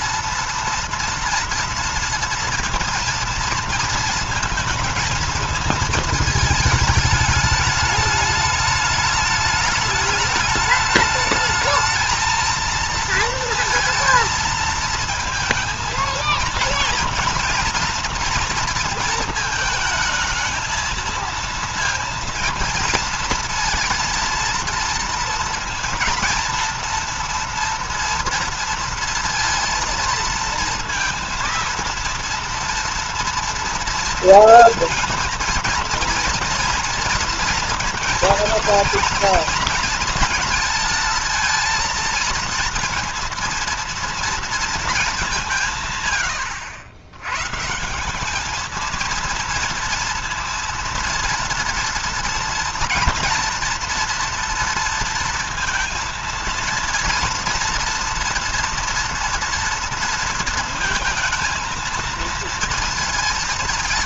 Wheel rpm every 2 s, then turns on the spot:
240, 230, 230, 220, 210, 210, 220, 230, 230, 240, 220, 230, 230, 240, 230, 230, 230, 230, 230, 230, 230, 230, 230, 100, 210, 230, 230, 230, 230, 230, 230, 230.
none